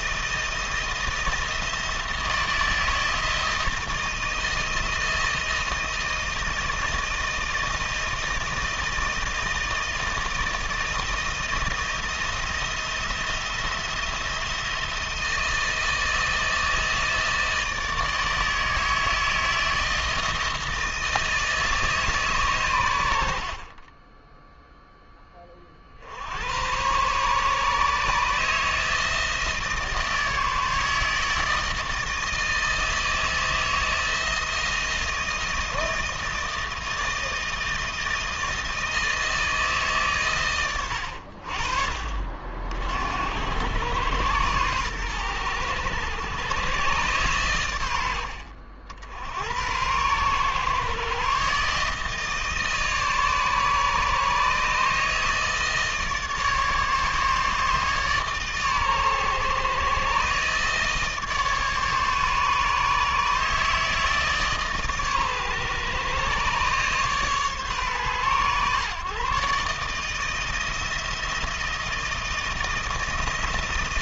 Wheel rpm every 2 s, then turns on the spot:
170, 160, 160, 160, 160, 160, 170, 160, 160, 160, 160, 80, 10, 120, 160, 160, 160, 160, 160, 160, 80, 70, 110, 120, 80, 140, 150, 150, 150, 130, 150, 150, 140, 140, 140, 160, 160.
none